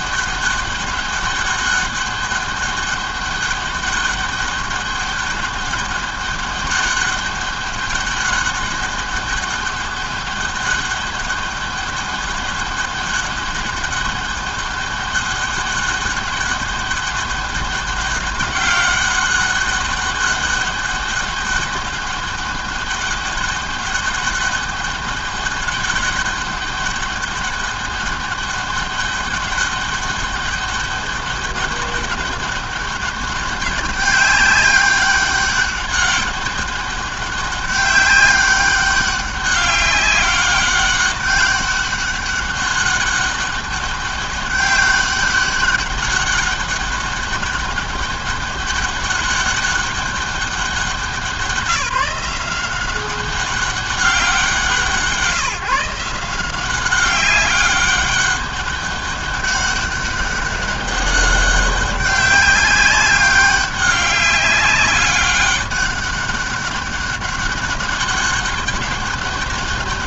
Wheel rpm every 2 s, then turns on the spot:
200, 200, 200, 200, 200, 200, 200, 200, 200, 190, 200, 200, 200, 200, 200, 200, 200, 200, 200, 200, 200, 200, 200, 200, 200, 190, 180, 170, 190, 200, 200, 200, 190, 200, 160.
none